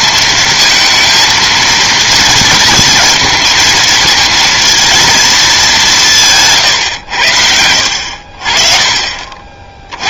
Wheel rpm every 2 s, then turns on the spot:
220, 230, 230, 150, 60.
none